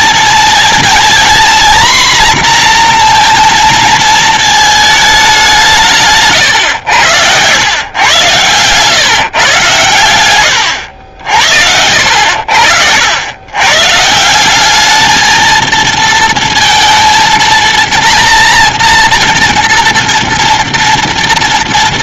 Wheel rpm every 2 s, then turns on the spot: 230, 240, 210, 90, 140, 80, 80, 210, 230, 240, 230.
none